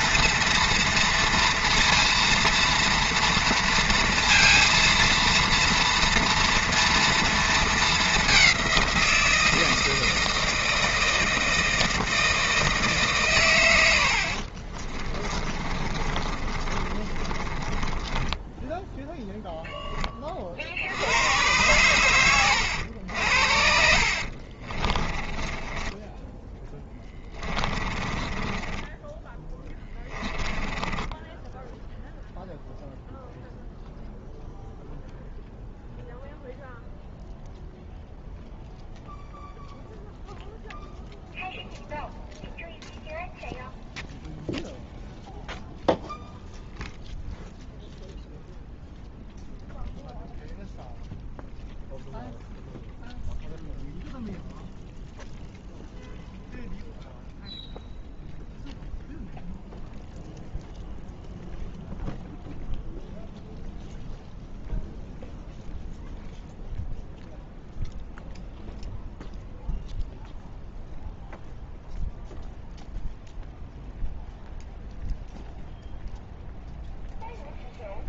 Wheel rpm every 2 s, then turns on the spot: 230, 230, 230, 230, 170, 160, 140, 40, 30, 0, 90, 80, 20, 10, 10, 10, 0, 0, 0, 0, 0, 0, 0, 0, 0, 0, 0, 0, 0, 0, 0, 0, 0, 0, 0, 0, 0, 0, 0.
14-18 24-32